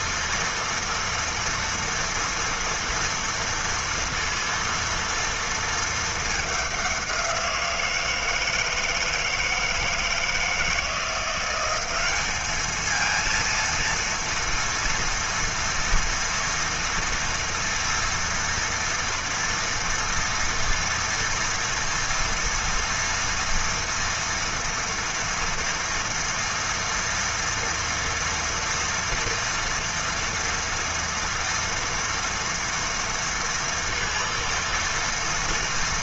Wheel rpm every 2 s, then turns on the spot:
230, 230, 230, 200, 160, 160, 220, 230, 230, 230, 230, 230, 230, 230, 230, 230, 230, 230.
none